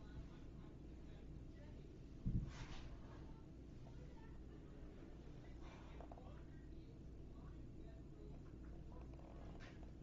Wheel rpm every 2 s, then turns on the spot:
0, 0, 0, 0, 0.
none